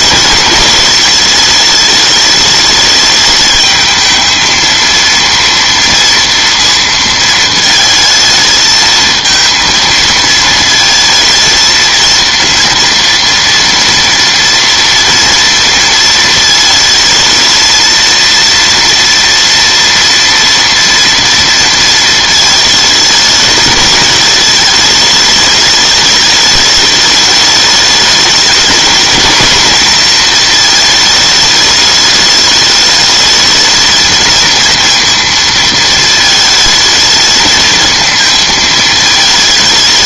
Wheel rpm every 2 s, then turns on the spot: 200, 210, 230, 230, 220, 220, 230, 230, 220, 230, 230, 220, 210, 210, 220, 220, 210, 230, 220, 220.
none